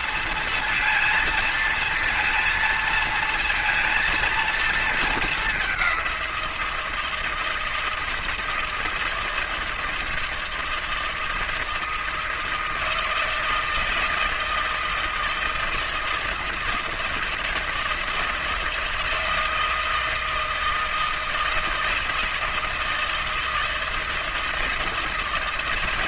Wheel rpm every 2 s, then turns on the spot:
230, 230, 230, 170, 160, 160, 160, 160, 160, 160, 160, 160, 160.
none